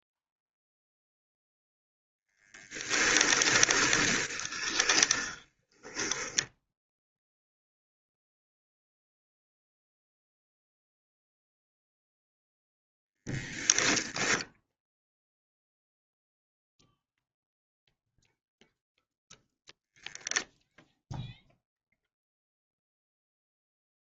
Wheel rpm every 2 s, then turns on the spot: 0, 10, 20, 0, 0, 0, 0, 0, 0, 0, 0, 0.
2-6